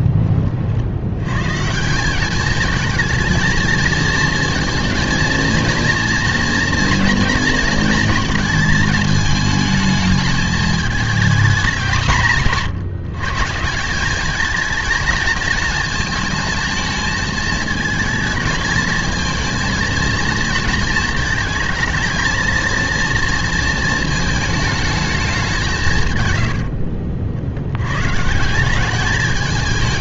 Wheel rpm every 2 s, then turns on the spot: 40, 220, 230, 230, 220, 210, 150, 220, 220, 220, 220, 230, 220, 90, 170.
26-28